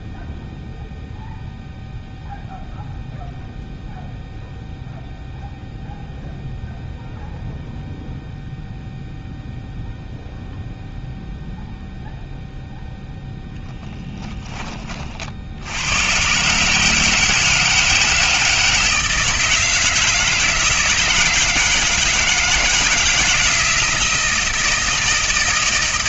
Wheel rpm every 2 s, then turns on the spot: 0, 0, 0, 0, 0, 0, 0, 40, 160, 160, 160, 160, 160.
none